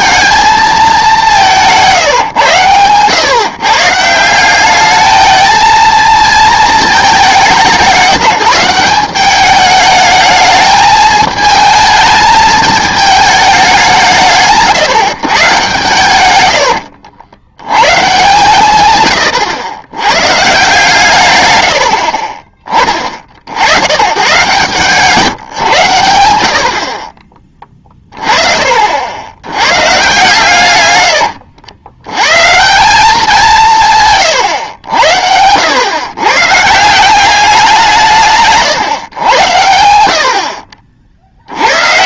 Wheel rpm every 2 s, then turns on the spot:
210, 120, 200, 220, 170, 220, 220, 150, 90, 130, 150, 30, 140, 60, 50, 120, 160, 100, 150, 140, 50.
16-18 24-26 38-40